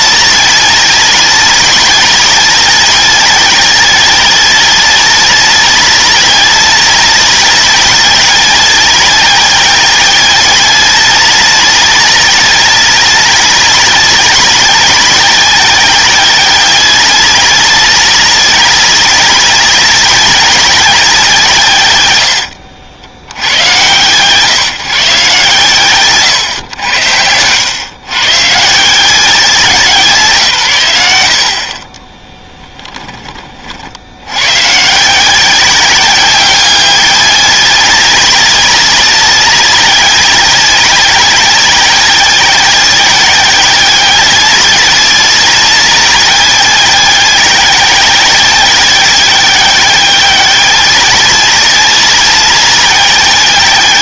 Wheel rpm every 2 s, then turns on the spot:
200, 190, 200, 200, 190, 200, 200, 190, 190, 200, 180, 80, 140, 90, 160, 120, 10, 130, 190, 200, 190, 190, 190, 190, 190, 190, 190.
32-34